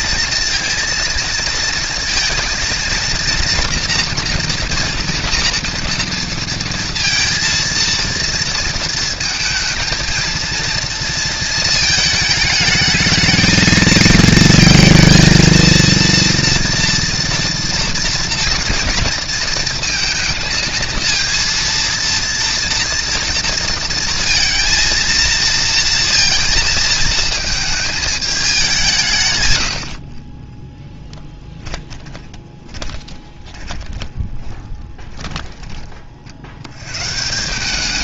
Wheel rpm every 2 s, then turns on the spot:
230, 230, 230, 230, 230, 230, 220, 220, 230, 230, 230, 230, 230, 230, 200, 20, 10, 20, 80.
30-36